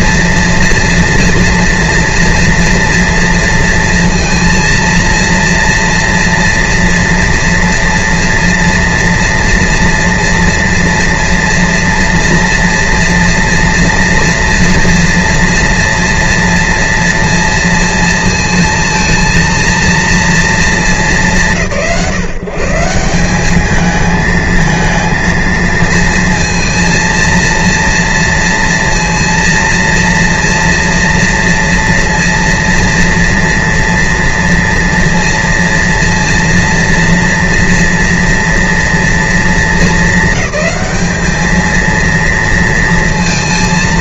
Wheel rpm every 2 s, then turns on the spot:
230, 240, 230, 230, 230, 240, 230, 230, 230, 230, 230, 150, 220, 230, 230, 230, 230, 240, 230, 240, 200, 230.
none